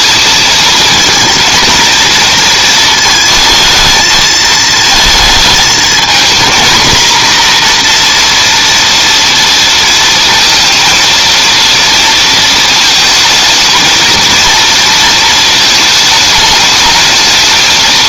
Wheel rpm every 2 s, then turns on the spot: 230, 230, 220, 230, 230, 230, 220, 230, 220.
none